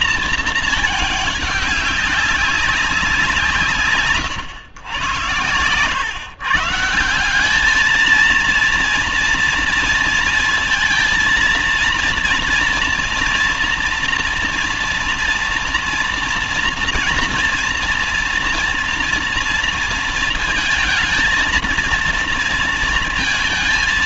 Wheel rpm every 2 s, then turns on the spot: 220, 190, 130, 140, 230, 230, 230, 230, 230, 230, 220, 230.
none